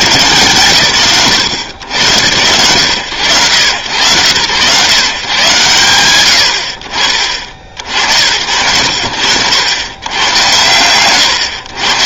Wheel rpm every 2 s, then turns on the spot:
100, 100, 120, 50, 80, 100.
none